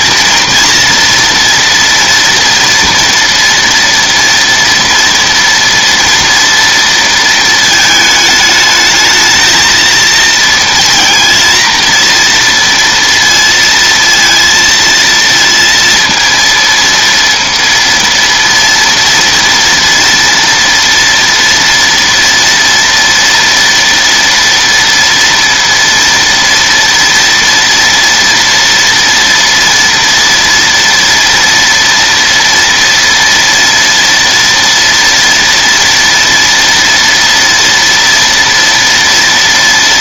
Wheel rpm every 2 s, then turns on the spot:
230, 230, 240, 230, 210, 230, 230, 230, 230, 230, 230, 230, 230, 230, 230, 230, 230, 230, 230, 230.
none